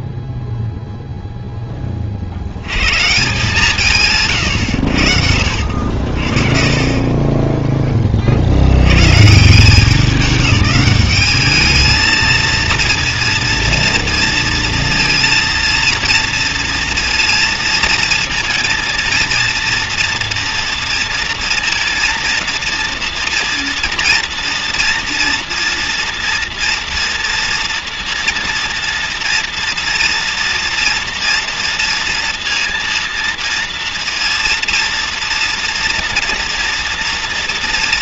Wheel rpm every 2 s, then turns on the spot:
0, 80, 130, 50, 50, 200, 230, 230, 230, 230, 230, 230, 230, 230, 230, 230, 230, 230, 230.
none